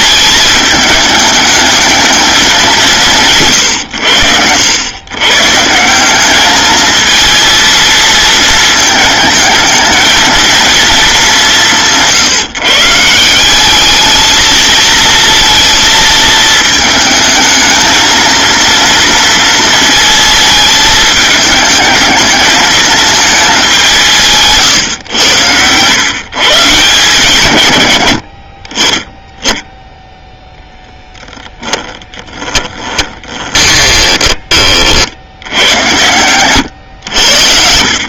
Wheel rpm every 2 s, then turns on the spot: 220, 180, 100, 220, 220, 230, 150, 230, 220, 230, 220, 220, 140, 140, 40, 10, 20, 30, 110.
32-34